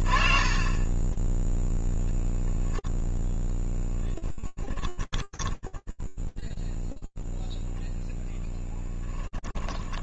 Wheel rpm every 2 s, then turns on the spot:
30, 0, 20, 0, 10.
4-6 8-10